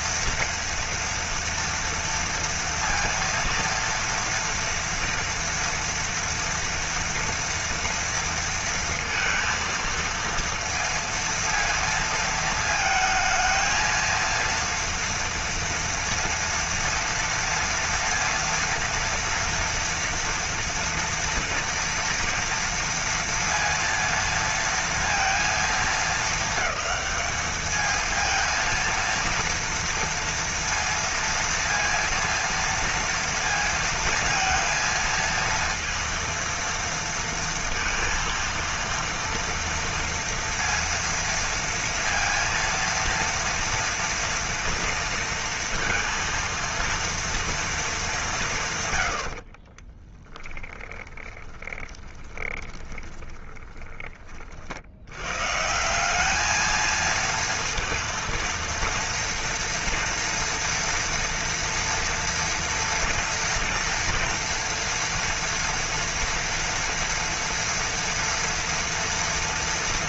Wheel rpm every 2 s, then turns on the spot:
230, 230, 230, 230, 230, 230, 230, 230, 230, 230, 230, 230, 230, 210, 230, 230, 230, 230, 230, 230, 230, 230, 230, 230, 190, 10, 20, 40, 210, 230, 240, 230, 230, 230, 230.
50-54